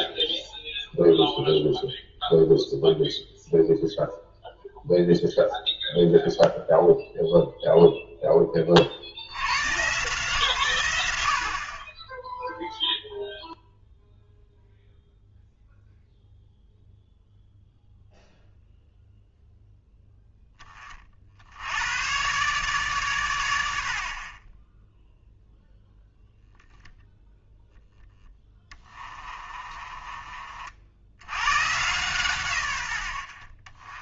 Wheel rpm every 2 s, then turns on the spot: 0, 0, 0, 0, 30, 120, 0, 0, 0, 0, 20, 130, 10, 0, 20, 50, 110.
28-30